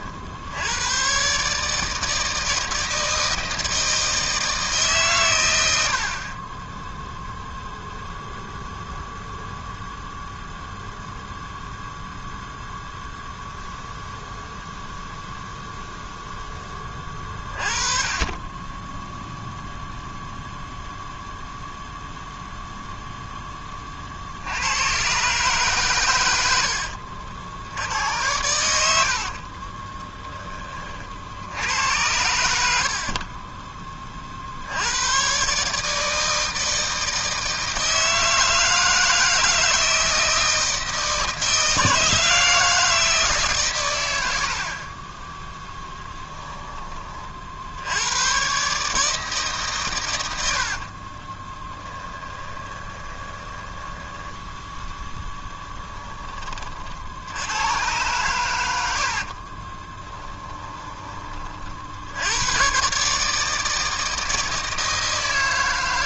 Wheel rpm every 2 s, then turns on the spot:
70, 160, 160, 40, 0, 0, 0, 0, 0, 20, 0, 0, 60, 110, 90, 20, 90, 50, 160, 160, 160, 160, 70, 10, 110, 90, 10, 10, 30, 110, 20, 90, 160.
52-54 60-62